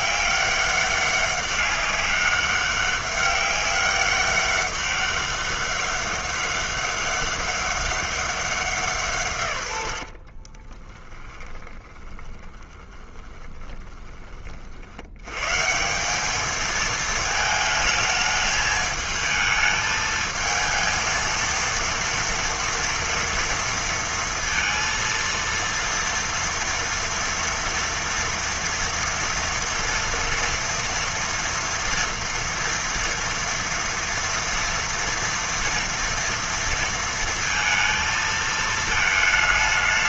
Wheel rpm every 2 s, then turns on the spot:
200, 200, 200, 200, 180, 30, 20, 50, 220, 220, 220, 230, 230, 230, 230, 230, 230, 230, 230, 220.
10-14